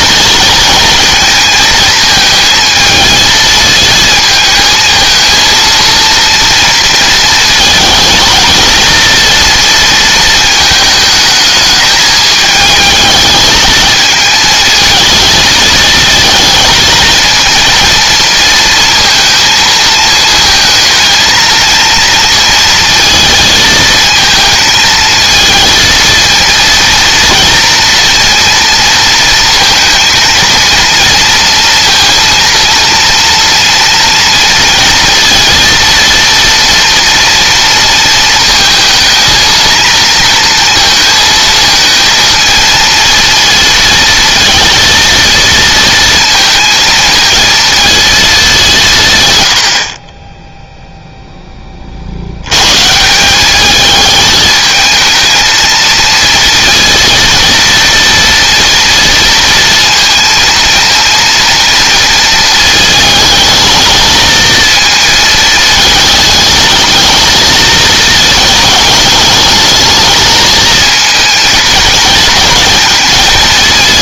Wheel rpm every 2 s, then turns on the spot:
230, 220, 220, 230, 230, 220, 220, 220, 230, 230, 220, 230, 230, 230, 230, 230, 230, 230, 230, 220, 230, 230, 230, 220, 160, 0, 150, 220, 230, 230, 230, 220, 220, 220, 210, 220, 220.
none